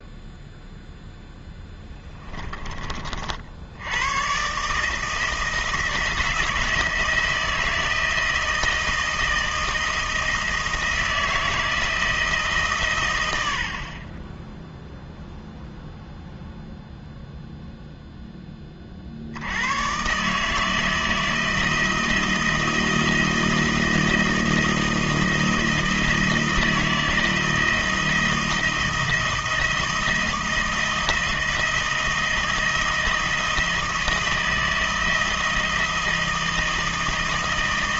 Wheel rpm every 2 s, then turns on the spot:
0, 30, 150, 160, 160, 160, 120, 0, 0, 40, 160, 160, 160, 160, 170, 170, 160, 160, 160.
none